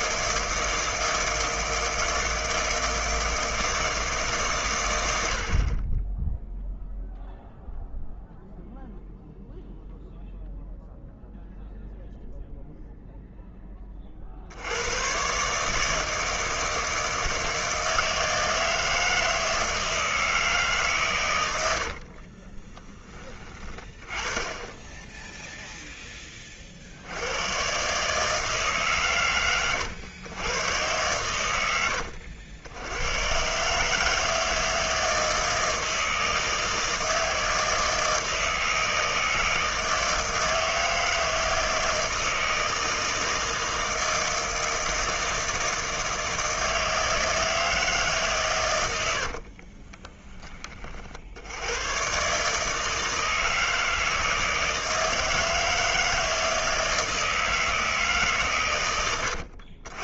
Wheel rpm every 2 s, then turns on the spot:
160, 160, 120, 0, 0, 0, 0, 80, 160, 160, 150, 30, 10, 40, 140, 120, 80, 160, 160, 160, 160, 160, 160, 160, 130, 30, 150, 160, 160, 130.
22-24